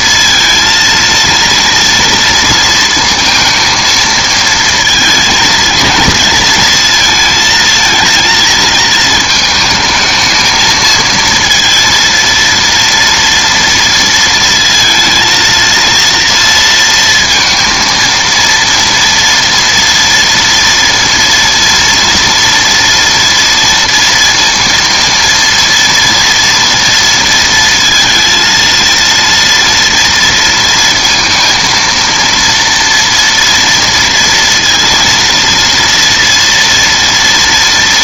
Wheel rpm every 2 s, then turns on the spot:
230, 230, 230, 220, 220, 220, 230, 230, 230, 230, 230, 230, 230, 230, 230, 230, 230, 230, 240.
none